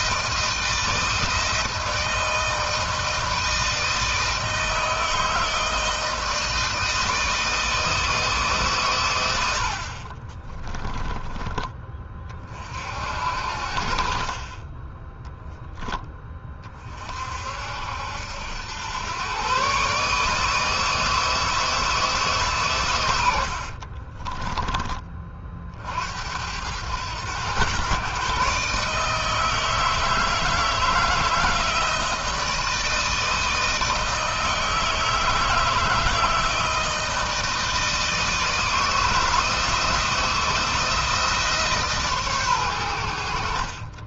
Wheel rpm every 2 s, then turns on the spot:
160, 160, 160, 160, 130, 20, 50, 20, 30, 100, 160, 140, 20, 90, 150, 160, 160, 160, 160, 160, 170, 110.
10-12